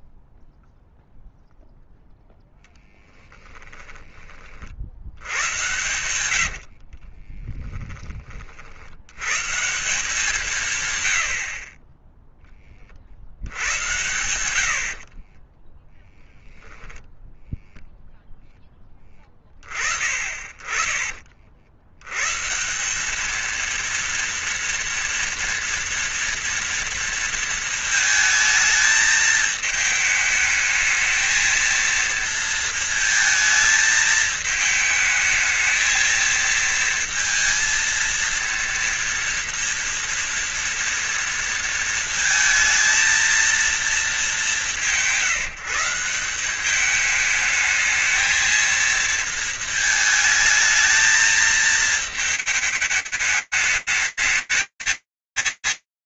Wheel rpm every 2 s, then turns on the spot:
0, 0, 40, 80, 40, 170, 10, 90, 0, 0, 30, 140, 230, 230, 220, 220, 230, 220, 230, 230, 230, 230, 200, 180, 220, 220, 220, 200.
6-8